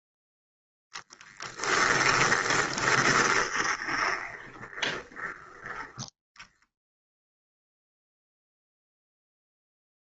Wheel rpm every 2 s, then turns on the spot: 0, 20, 20, 0, 0.
2-6